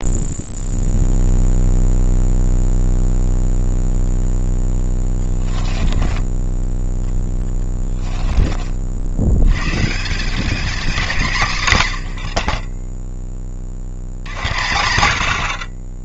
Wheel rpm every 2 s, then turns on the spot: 0, 0, 10, 10, 60, 210, 20, 80.
4-6